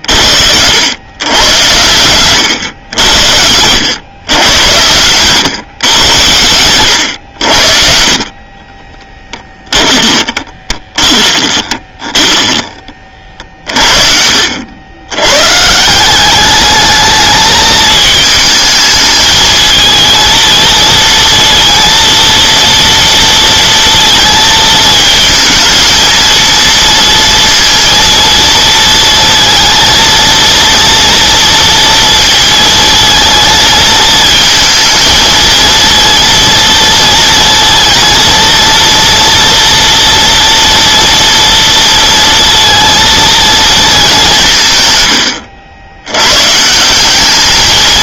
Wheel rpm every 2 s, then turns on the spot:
70, 100, 110, 90, 30, 20, 20, 70, 210, 220, 220, 230, 220, 230, 230, 230, 230, 220, 230, 230, 230, 230, 170, 140.
8-14